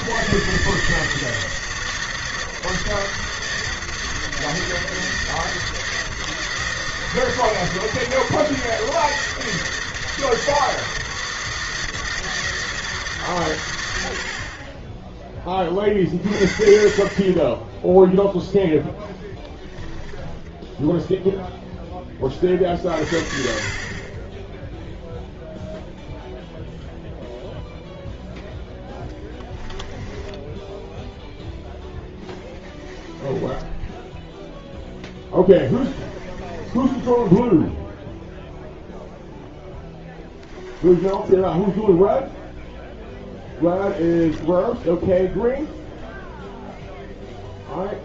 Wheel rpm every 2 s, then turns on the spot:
160, 160, 160, 160, 160, 160, 160, 50, 50, 0, 10, 30, 10, 0, 0, 10, 10, 0, 20, 0, 10, 0, 10, 0.
20-22 30-34 36-38 40-42 44-46